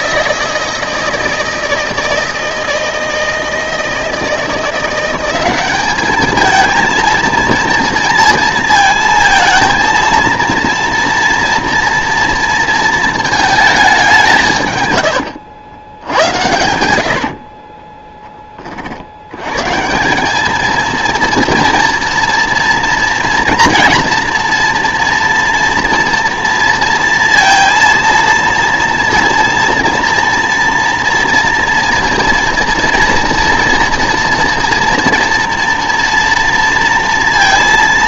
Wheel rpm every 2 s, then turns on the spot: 160, 160, 170, 230, 230, 230, 230, 120, 90, 50, 230, 230, 240, 230, 230, 230, 230, 230, 230.
16-18